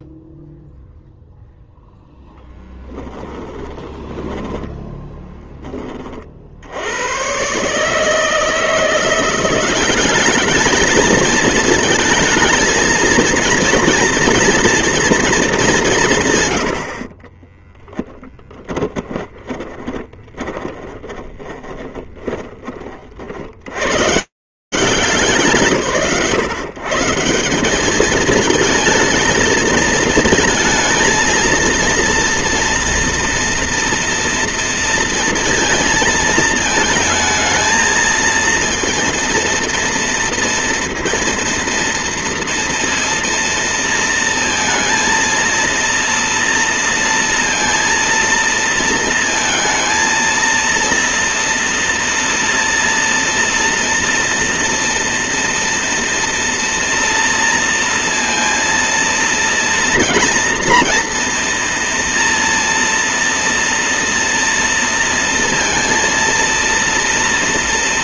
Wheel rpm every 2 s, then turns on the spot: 0, 10, 10, 80, 160, 210, 220, 230, 100, 10, 20, 30, 140, 170, 220, 230, 230, 230, 220, 230, 230, 230, 230, 230, 230, 230, 230, 230, 230, 230, 230, 230, 230, 230.
2-6 16-22